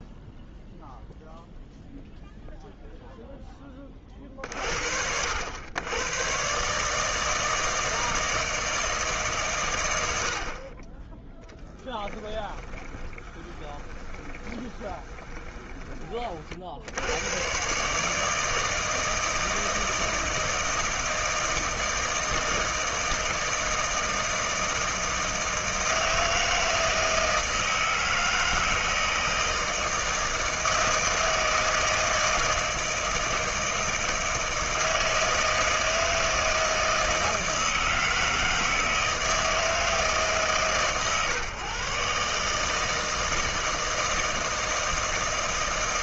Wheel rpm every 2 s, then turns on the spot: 0, 0, 60, 150, 160, 20, 20, 20, 70, 160, 160, 160, 160, 160, 160, 160, 160, 160, 160, 160, 130, 160, 160.
12-16